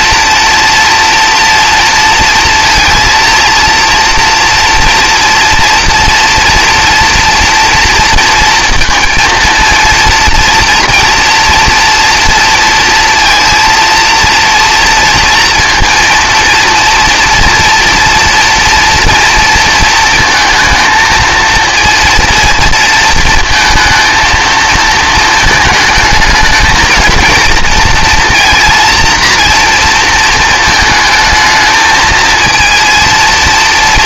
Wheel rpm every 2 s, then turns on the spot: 230, 230, 230, 230, 230, 230, 230, 230, 230, 230, 220, 230, 230, 220, 230, 220, 230.
none